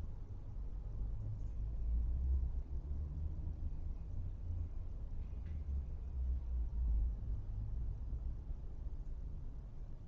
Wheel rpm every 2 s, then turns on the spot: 0, 0, 0, 0, 0.
none